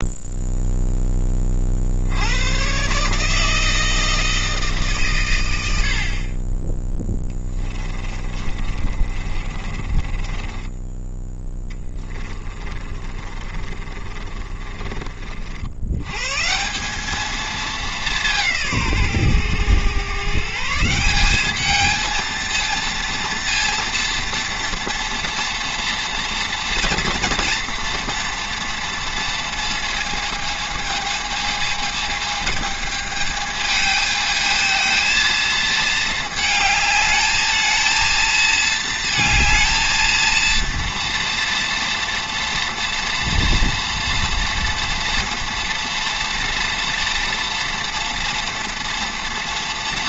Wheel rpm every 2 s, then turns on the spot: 0, 130, 140, 10, 30, 10, 20, 30, 190, 140, 170, 230, 230, 230, 230, 220, 220, 220, 220, 220, 230, 230, 230, 230, 230.
6-14